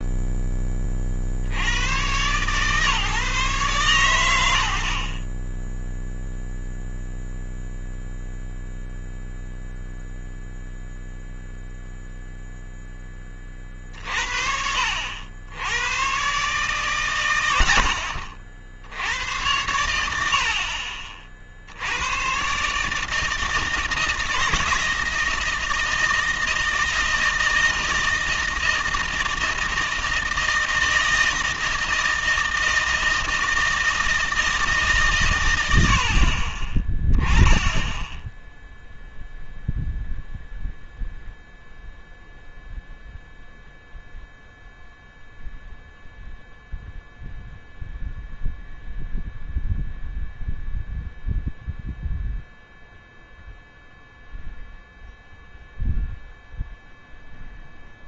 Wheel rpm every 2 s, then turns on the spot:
30, 140, 70, 0, 0, 0, 10, 70, 130, 70, 60, 150, 160, 160, 160, 160, 160, 150, 20, 0, 0, 0, 0, 0, 0, 0, 0, 0, 0.
none